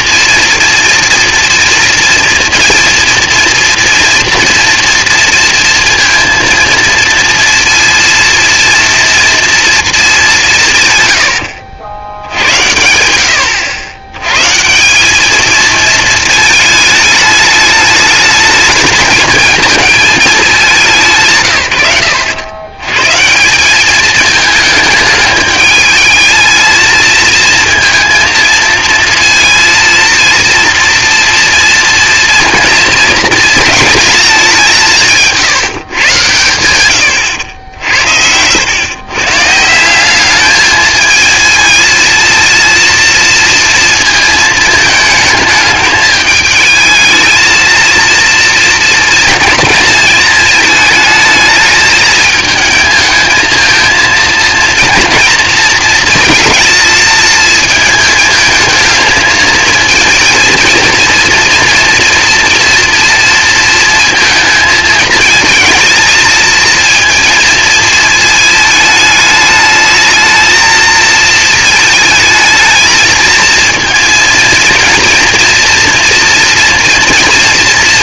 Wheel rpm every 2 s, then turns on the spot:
230, 230, 230, 230, 230, 180, 90, 130, 220, 220, 210, 100, 210, 220, 230, 230, 230, 200, 110, 90, 210, 230, 220, 220, 230, 220, 220, 230, 230, 220, 230, 240, 230, 230, 220, 220, 230, 230, 240.
none